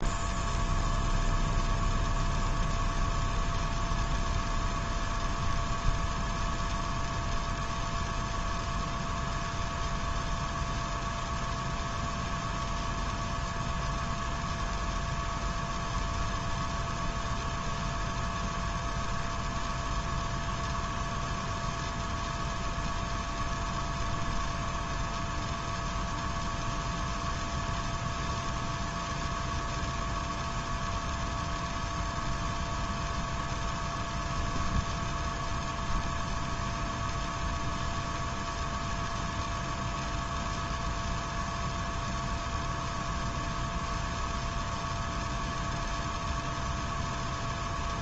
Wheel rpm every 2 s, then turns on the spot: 0, 0, 0, 0, 0, 0, 0, 0, 0, 0, 0, 0, 0, 0, 0, 0, 0, 0, 0, 0, 0, 0, 0, 0.
none